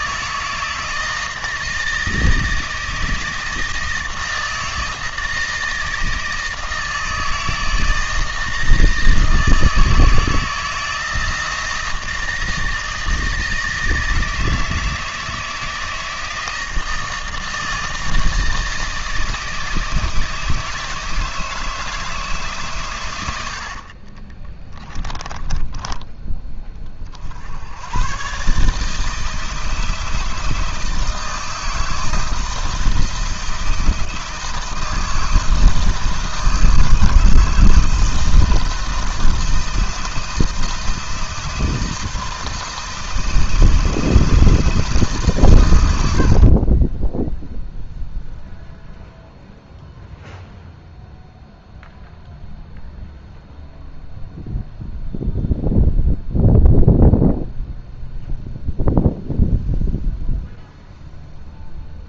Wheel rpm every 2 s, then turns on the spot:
160, 160, 160, 160, 160, 160, 160, 160, 160, 160, 160, 120, 20, 30, 150, 160, 160, 160, 160, 160, 160, 160, 160, 20, 0, 0, 0, 0, 0, 0, 0.
46-48